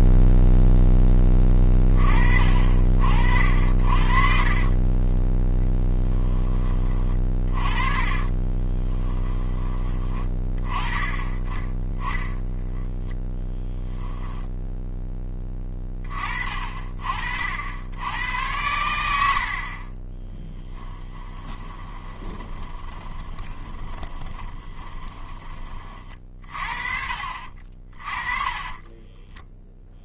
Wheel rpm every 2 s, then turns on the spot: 10, 50, 20, 20, 20, 30, 10, 10, 40, 90, 10, 20, 20, 40, 20.
4-6 8-10 18-26 28-30